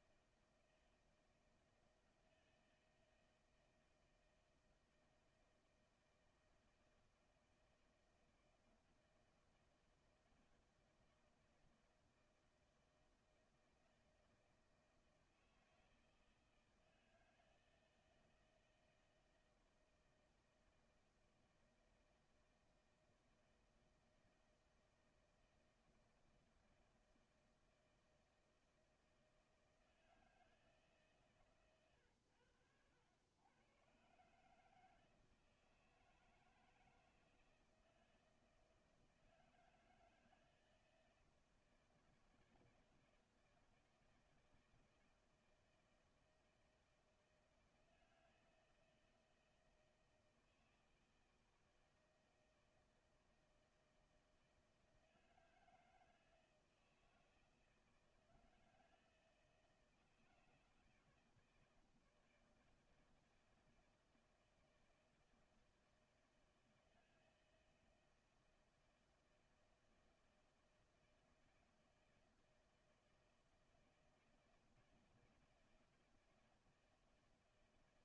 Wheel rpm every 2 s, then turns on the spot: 160, 160, 160, 160, 160, 160, 160, 160, 160, 160, 160, 160, 160, 160, 160, 160, 100, 140, 160, 160, 160, 170, 160, 160, 160, 160, 160, 170, 160, 160, 170, 160, 160, 160, 170, 160, 160, 160, 170.
none